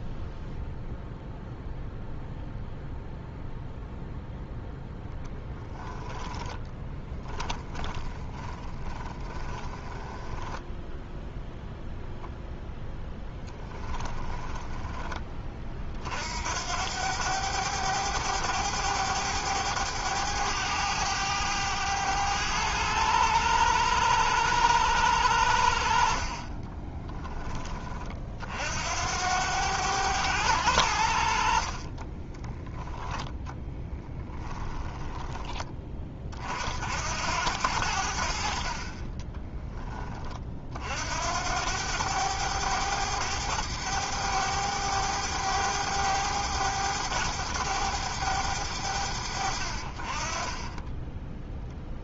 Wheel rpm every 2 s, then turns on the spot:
0, 0, 0, 10, 20, 10, 0, 20, 90, 100, 100, 100, 100, 20, 70, 80, 10, 10, 70, 40, 60, 100, 100, 100, 80, 10.
6-10 14-16 26-28 34-36 50-52